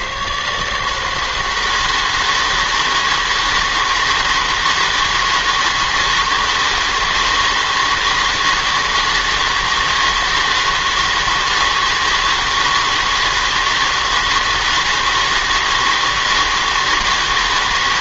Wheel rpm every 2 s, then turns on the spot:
140, 160, 160, 160, 160, 160, 160, 160, 160.
none